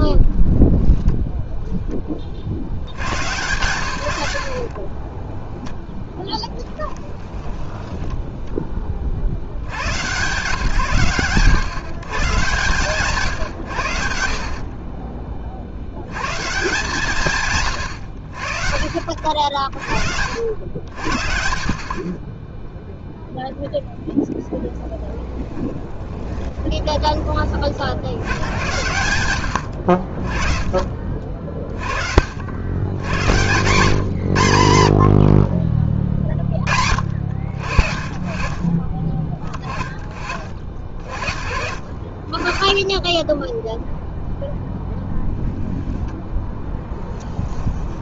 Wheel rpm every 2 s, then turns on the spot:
0, 70, 50, 10, 20, 130, 140, 50, 140, 50, 90, 10, 10, 20, 100, 30, 80, 100, 50, 30, 50, 10, 10, 10.
4-8 26-28 46-48